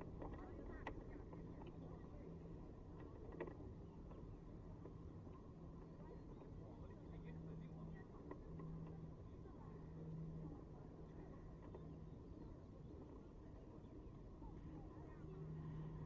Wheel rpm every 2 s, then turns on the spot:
0, 0, 0, 0, 0, 0, 0, 0.
none